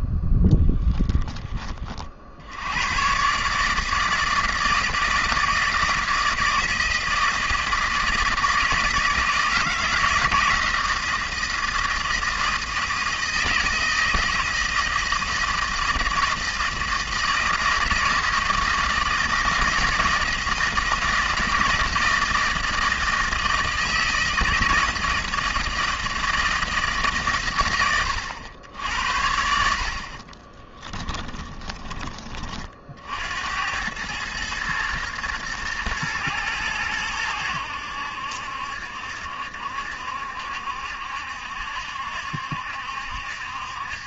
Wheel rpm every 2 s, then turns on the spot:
10, 90, 160, 160, 160, 160, 160, 160, 160, 160, 160, 160, 160, 160, 90, 20, 40, 110, 110, 70, 70, 70.
30-32